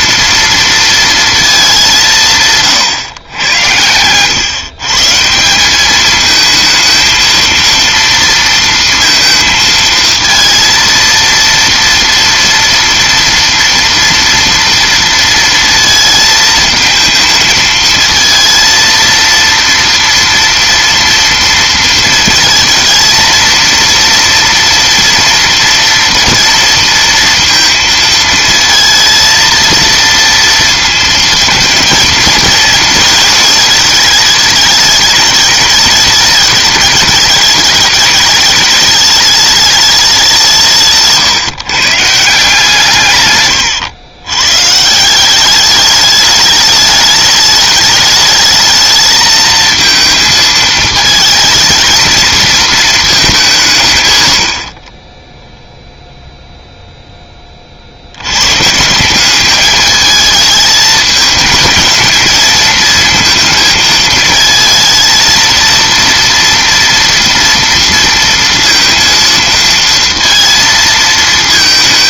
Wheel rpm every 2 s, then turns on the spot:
230, 140, 130, 220, 230, 230, 230, 230, 220, 230, 230, 230, 230, 230, 230, 230, 230, 210, 210, 210, 170, 160, 140, 210, 220, 220, 220, 40, 0, 140, 220, 220, 230, 230, 230, 230.
none